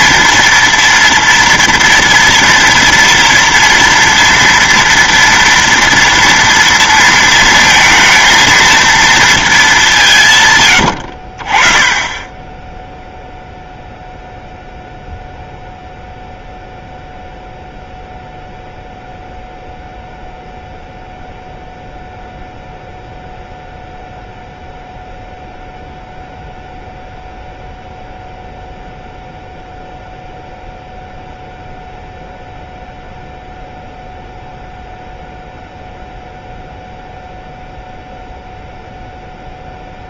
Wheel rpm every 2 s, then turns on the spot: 230, 230, 230, 230, 230, 100, 10, 0, 0, 0, 0, 0, 0, 0, 0, 0, 0, 0, 0, 0.
10-12